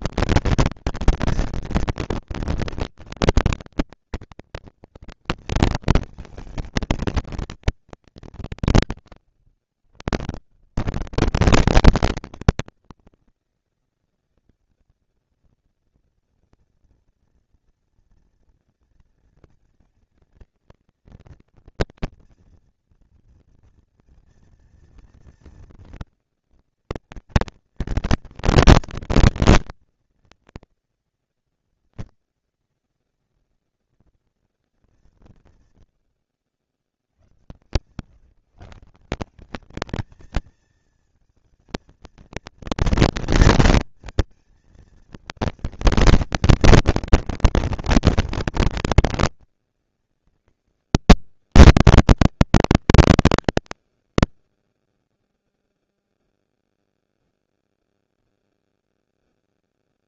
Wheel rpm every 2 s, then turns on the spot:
230, 230, 240, 220, 200, 80, 190, 200, 230, 230, 220, 230, 230, 230, 230, 230, 240, 230, 80, 150, 220, 230, 230, 230, 230, 270, 310, 200, 0, 0.
36-38